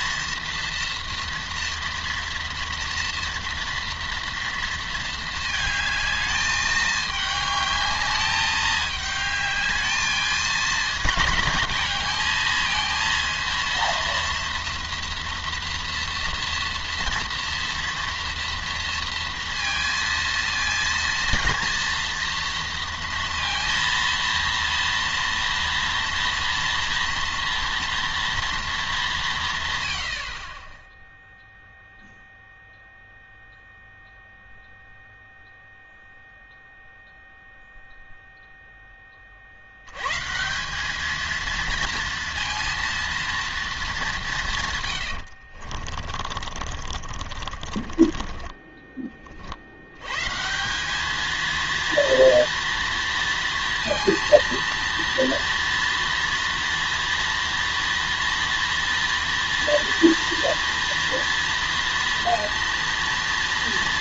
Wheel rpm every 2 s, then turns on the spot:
230, 230, 230, 210, 210, 220, 220, 230, 240, 230, 230, 230, 230, 230, 230, 40, 0, 0, 0, 0, 150, 230, 170, 40, 20, 150, 230, 230, 230, 240, 230, 230.
30-32 46-50